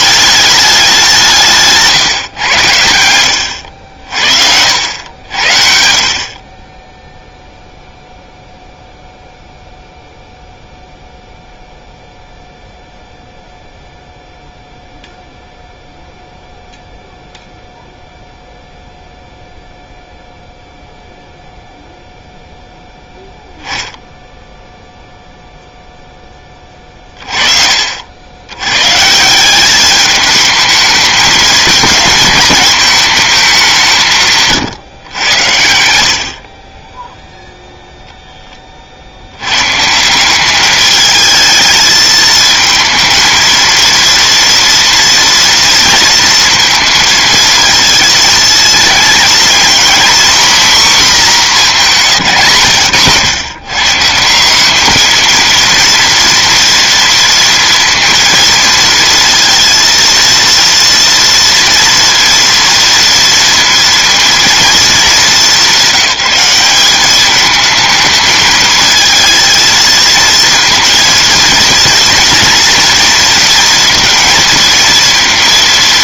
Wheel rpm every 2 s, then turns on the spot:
190, 90, 80, 20, 0, 0, 0, 0, 0, 0, 0, 0, 0, 20, 110, 220, 210, 140, 30, 20, 210, 220, 240, 230, 230, 250, 120, 200, 230, 230, 230, 230, 220, 190, 220, 230, 230, 230.
34-38